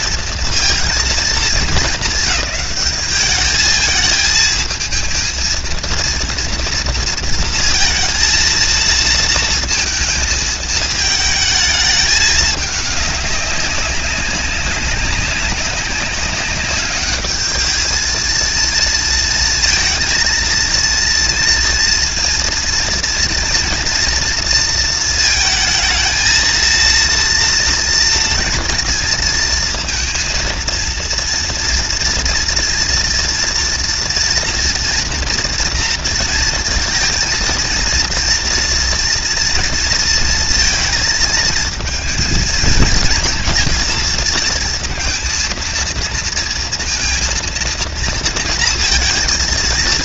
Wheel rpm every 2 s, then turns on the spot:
210, 200, 230, 230, 230, 220, 200, 190, 210, 230, 230, 230, 230, 230, 230, 230, 230, 230, 230, 230, 220, 220, 230, 230, 220.
none